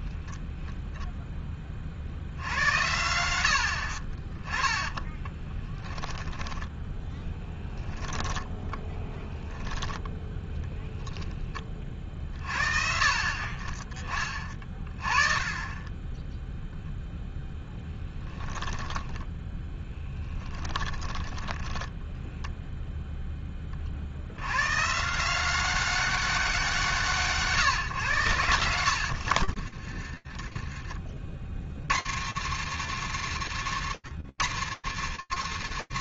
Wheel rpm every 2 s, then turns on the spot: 0, 90, 20, 10, 10, 10, 40, 30, 0, 10, 10, 0, 130, 180, 90, 40, 120, 130.
4-10 18-22 28-30